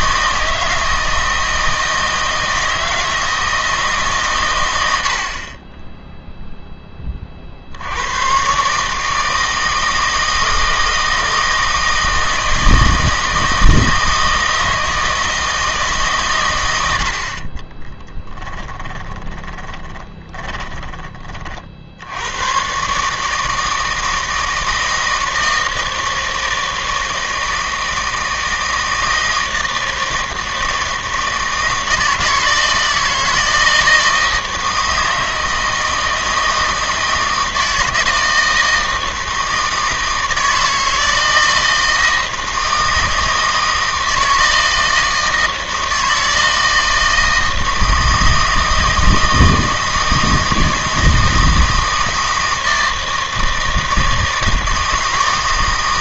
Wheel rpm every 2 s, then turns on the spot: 160, 160, 100, 0, 130, 160, 160, 160, 100, 10, 20, 130, 160, 160, 160, 160, 160, 160, 160, 160, 160, 160, 160, 160, 160, 160, 160, 160.
18-22